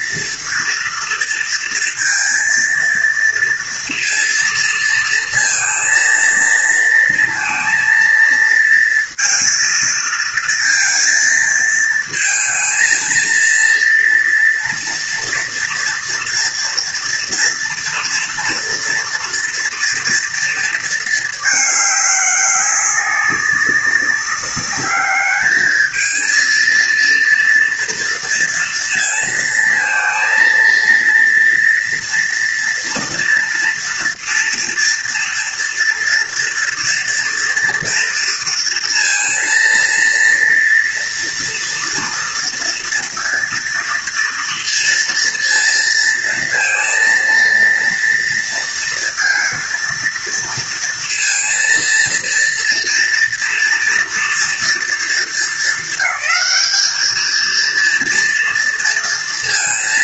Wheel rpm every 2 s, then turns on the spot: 230, 230, 230, 230, 230, 230, 230, 230, 230, 240, 230, 200, 200, 230, 230, 230, 230, 230, 230, 230, 230, 230, 230, 230, 230, 230, 230, 230, 220, 230.
none